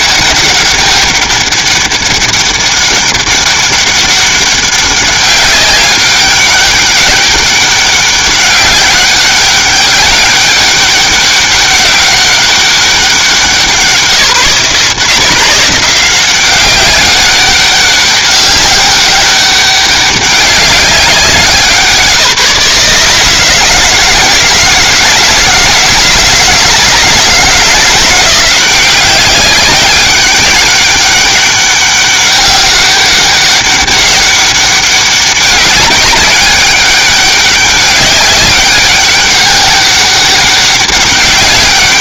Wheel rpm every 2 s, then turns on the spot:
200, 200, 200, 200, 200, 200, 180, 160, 190, 200, 180, 150, 160, 160, 190, 200, 200, 200, 200, 200, 200.
none